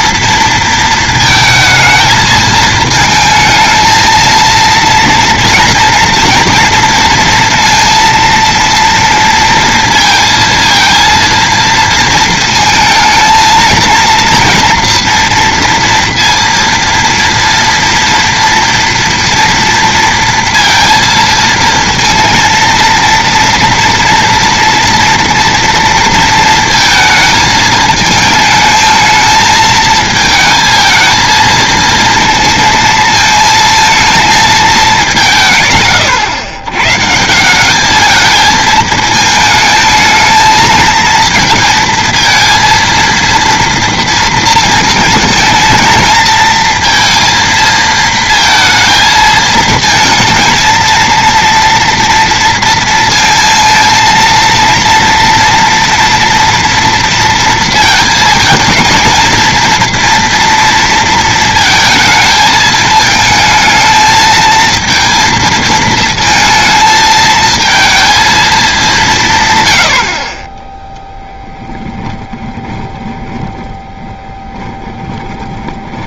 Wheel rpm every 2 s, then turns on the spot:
230, 220, 230, 230, 230, 230, 220, 230, 230, 230, 230, 230, 230, 220, 220, 220, 230, 210, 130, 220, 220, 230, 230, 230, 220, 230, 230, 230, 230, 220, 230, 220, 230, 220, 200, 10, 20, 20.
72-76